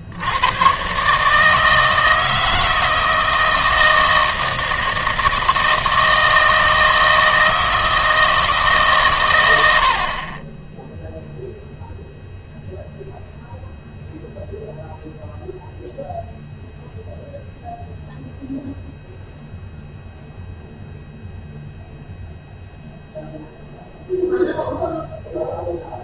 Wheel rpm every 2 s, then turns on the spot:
120, 160, 160, 160, 150, 10, 0, 0, 0, 0, 0, 0, 0.
none